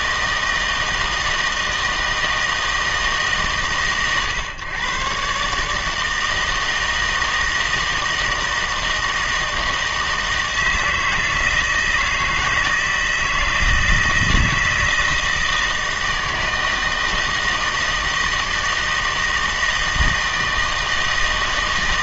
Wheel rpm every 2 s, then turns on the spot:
160, 160, 130, 160, 160, 160, 160, 160, 160, 160, 160.
none